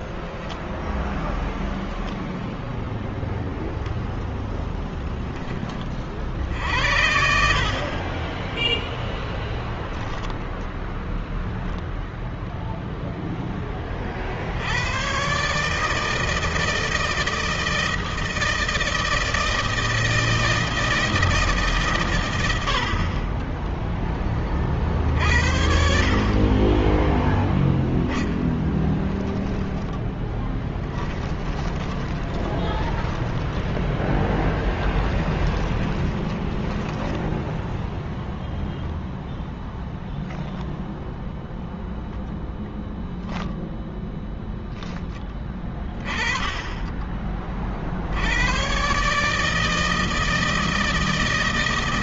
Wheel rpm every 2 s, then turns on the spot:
0, 0, 0, 60, 10, 0, 0, 50, 160, 160, 160, 110, 10, 30, 10, 10, 20, 20, 10, 0, 0, 0, 10, 20, 90, 160.
8-10 30-38